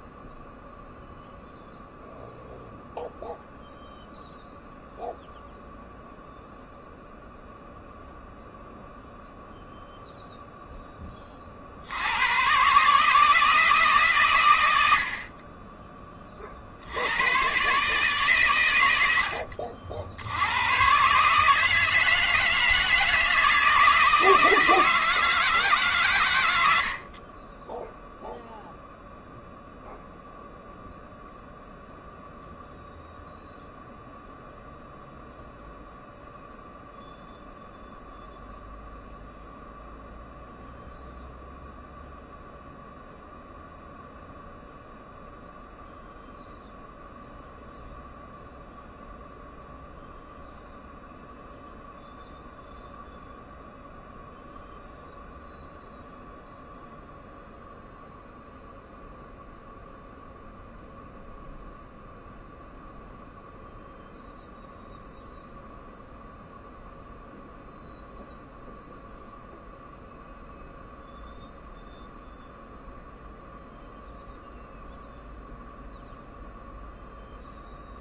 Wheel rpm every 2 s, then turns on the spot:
0, 0, 0, 0, 0, 0, 130, 100, 70, 110, 100, 160, 160, 80, 0, 0, 0, 0, 0, 0, 0, 0, 0, 0, 0, 0, 0, 0, 0, 0, 0, 0, 0, 0, 0, 0, 0, 0, 0.
none